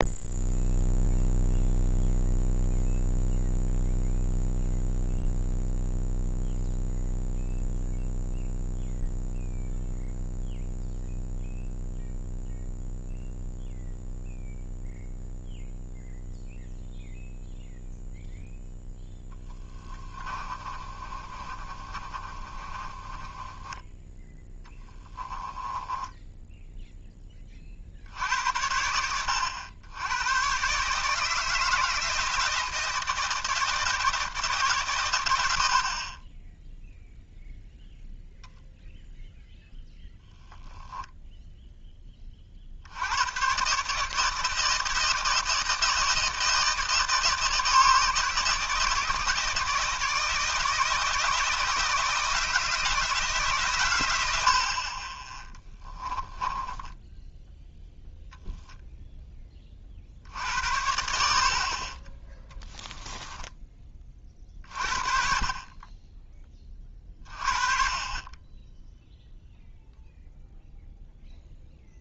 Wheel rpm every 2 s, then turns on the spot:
0, 0, 0, 0, 0, 0, 0, 0, 0, 0, 30, 30, 10, 0, 80, 140, 160, 130, 0, 0, 0, 60, 160, 160, 160, 160, 160, 40, 10, 0, 70, 10, 40, 30, 10, 0.
20-26 56-58 62-64